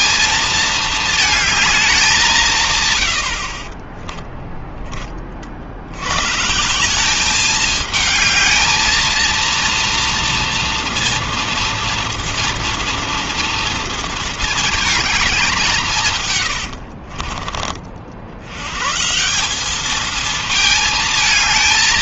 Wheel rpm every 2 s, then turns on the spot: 220, 80, 30, 200, 230, 230, 230, 210, 50, 150, 220.
2-4 16-18